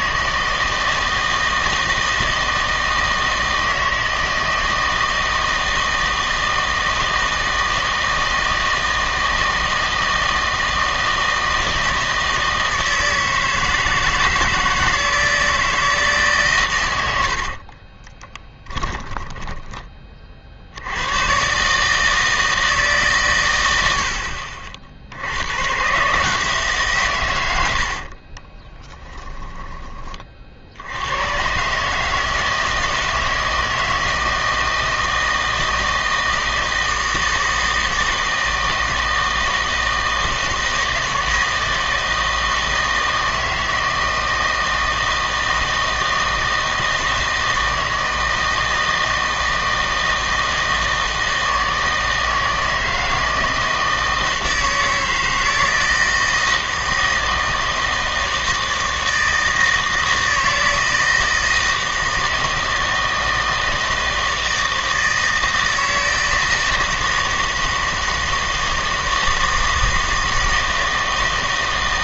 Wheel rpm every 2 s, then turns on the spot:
160, 160, 160, 160, 160, 160, 160, 160, 110, 10, 70, 160, 60, 150, 20, 70, 160, 160, 160, 160, 160, 160, 160, 160, 160, 160, 160, 160, 160, 160, 160, 160, 160, 160, 160, 160.
18-20 28-30